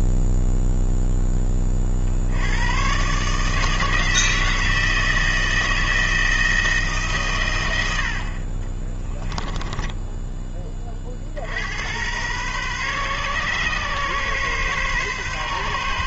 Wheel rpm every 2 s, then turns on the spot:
0, 110, 160, 160, 30, 30, 130, 130.
8-10